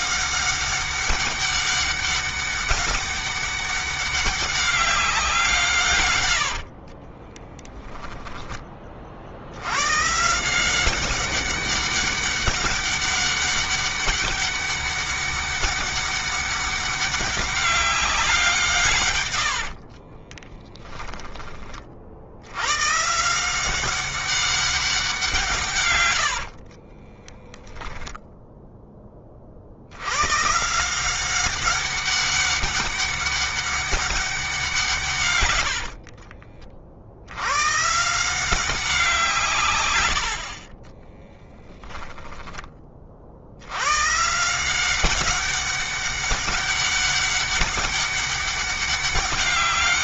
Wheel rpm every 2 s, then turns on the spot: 200, 200, 190, 40, 20, 180, 200, 200, 200, 160, 10, 110, 190, 40, 10, 160, 190, 160, 50, 180, 30, 20, 180, 200, 200.
6-8 20-22 26-28 40-42